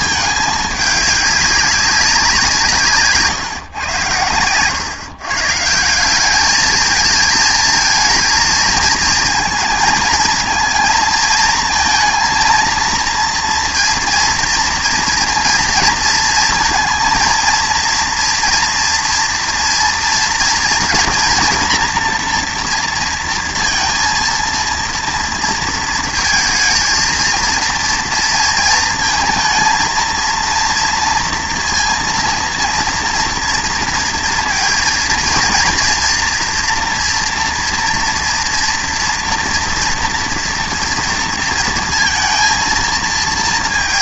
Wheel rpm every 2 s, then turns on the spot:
210, 170, 120, 210, 230, 230, 230, 230, 230, 240, 230, 240, 230, 230, 230, 230, 230, 230, 230, 230, 230, 220.
none